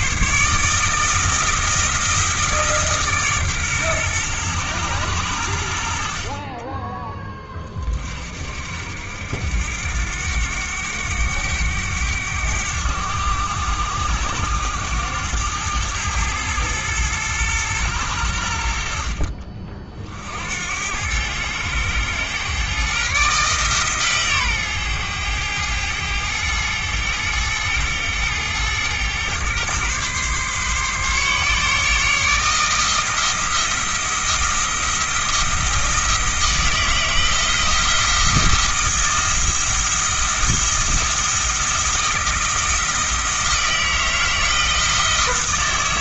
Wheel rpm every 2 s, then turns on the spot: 150, 160, 110, 20, 60, 90, 100, 100, 110, 80, 80, 130, 120, 110, 110, 140, 160, 170, 160, 160, 170, 160, 160.
none